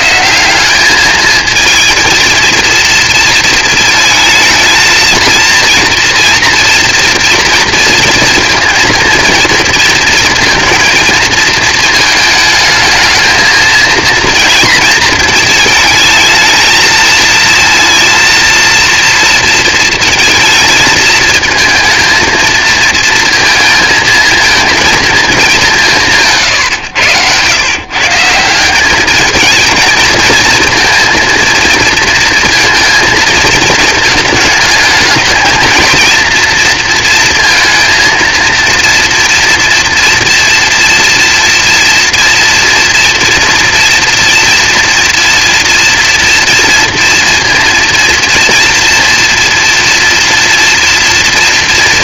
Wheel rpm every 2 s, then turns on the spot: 190, 230, 220, 230, 230, 230, 220, 230, 220, 230, 220, 230, 220, 130, 180, 230, 230, 210, 230, 230, 230, 230, 230, 230, 230, 230.
none